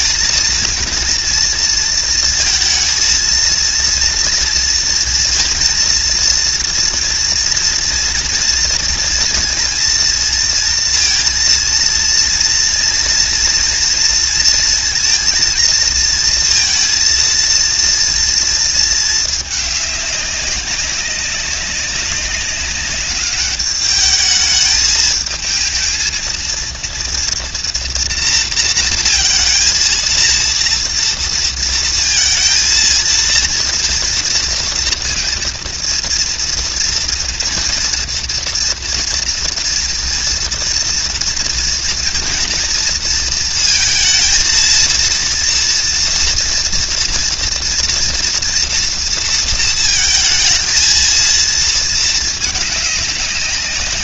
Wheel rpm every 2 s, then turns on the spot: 230, 230, 230, 230, 230, 230, 230, 230, 230, 220, 200, 200, 220, 230, 230, 230, 230, 230, 230, 230, 230, 230, 230, 240, 230, 220, 200.
none